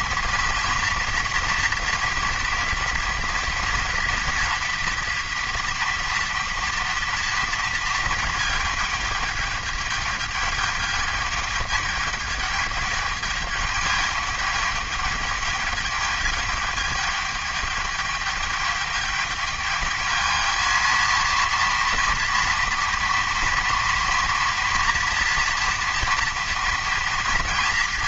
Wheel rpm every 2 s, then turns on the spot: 230, 230, 230, 230, 210, 210, 210, 210, 210, 210, 220, 230, 230, 230.
none